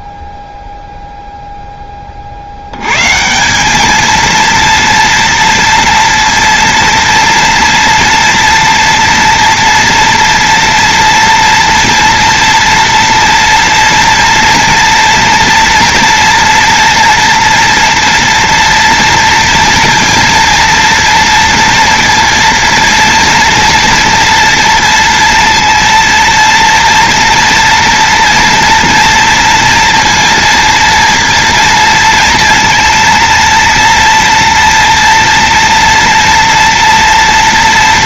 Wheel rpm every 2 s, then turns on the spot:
0, 60, 230, 230, 230, 230, 230, 230, 230, 230, 230, 230, 230, 230, 230, 230, 230, 230, 230.
none